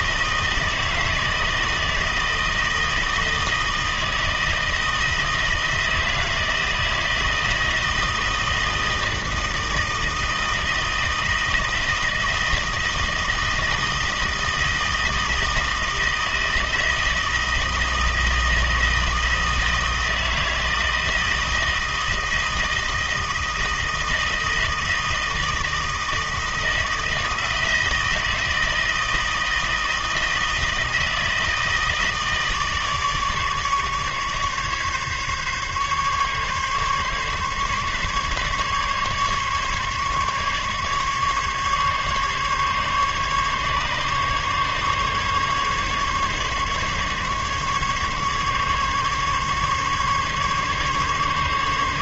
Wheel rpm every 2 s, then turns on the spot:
160, 160, 160, 160, 160, 160, 160, 160, 160, 160, 160, 160, 160, 160, 160, 160, 150, 150, 140, 140, 140, 140, 140, 140, 140, 140.
none